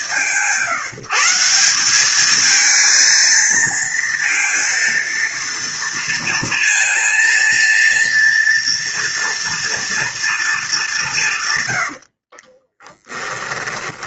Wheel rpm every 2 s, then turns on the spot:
180, 210, 230, 230, 230, 220, 40.
12-14